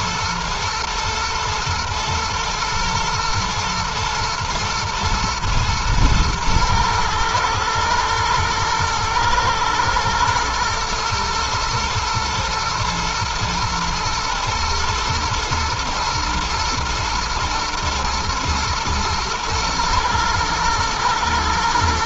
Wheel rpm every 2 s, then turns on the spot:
120, 120, 110, 110, 110, 110, 110, 120, 110, 120, 110.
none